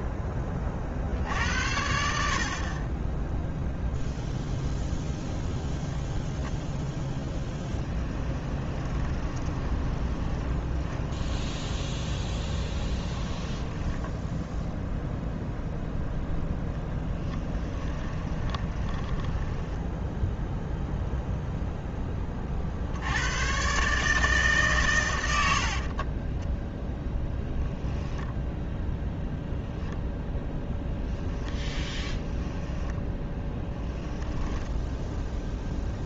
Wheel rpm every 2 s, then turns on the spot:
40, 10, 0, 10, 20, 20, 10, 0, 10, 10, 0, 130, 60, 0, 0, 0, 10, 0.
6-14 16-20 24-26 32-34